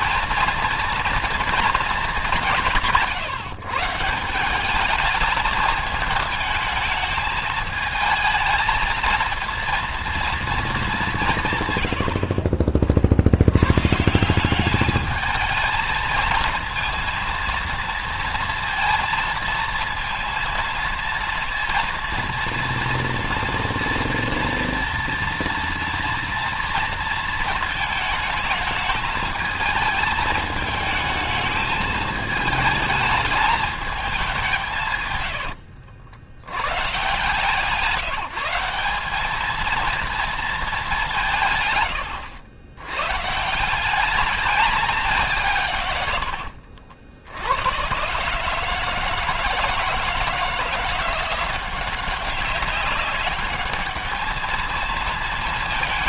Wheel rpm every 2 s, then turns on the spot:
230, 170, 210, 220, 220, 210, 50, 200, 230, 230, 230, 230, 230, 230, 220, 220, 210, 150, 130, 200, 200, 110, 200, 70, 160, 170, 200, 220.
none